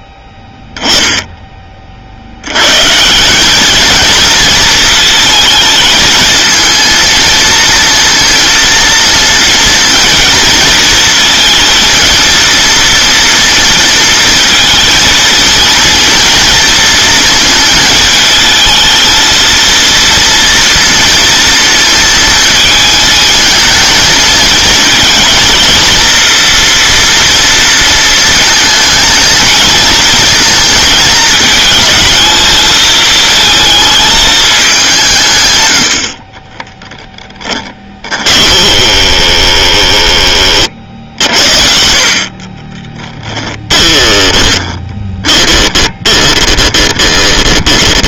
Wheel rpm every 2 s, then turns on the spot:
10, 140, 230, 230, 230, 220, 230, 220, 230, 220, 230, 220, 230, 240, 230, 230, 220, 180, 20, 20, 50, 20, 20, 20.
36-40 42-48